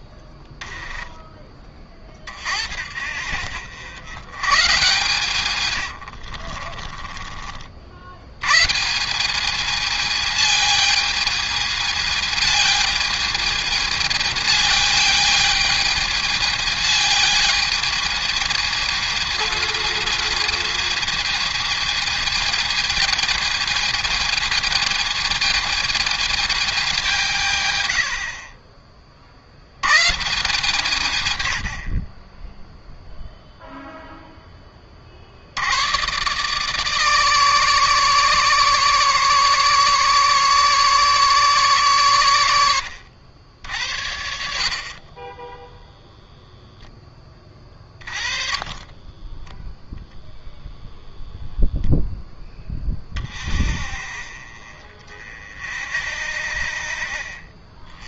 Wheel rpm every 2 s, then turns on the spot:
10, 50, 130, 40, 130, 220, 220, 220, 220, 220, 220, 220, 220, 210, 50, 150, 10, 30, 150, 140, 140, 90, 40, 10, 30, 0, 10, 40, 50.
0-2 6-8 48-50